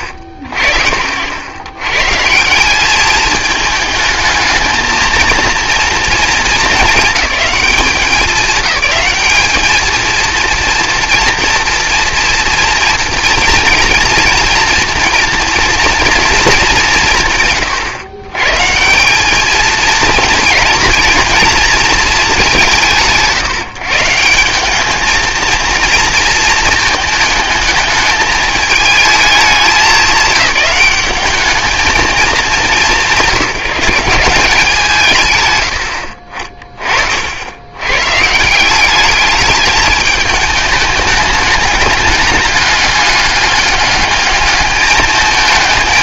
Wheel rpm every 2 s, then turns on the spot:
60, 180, 220, 220, 210, 230, 240, 230, 220, 120, 230, 190, 190, 230, 220, 210, 180, 180, 40, 170, 210, 210, 210.
36-38